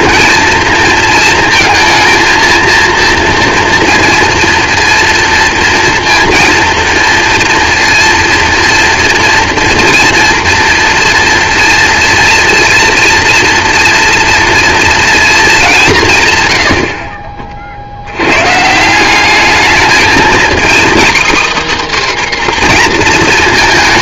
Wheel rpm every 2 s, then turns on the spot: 230, 230, 230, 230, 230, 240, 230, 230, 100, 150, 260, 250.
none